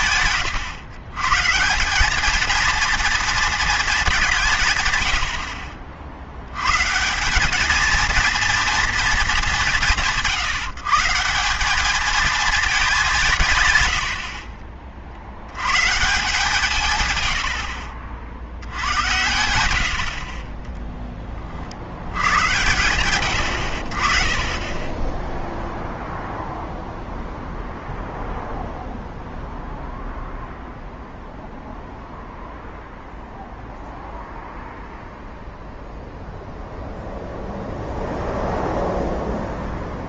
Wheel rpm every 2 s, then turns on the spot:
110, 220, 150, 110, 230, 150, 210, 40, 150, 70, 20, 110, 20, 0, 0, 0, 0, 0, 0, 0.
none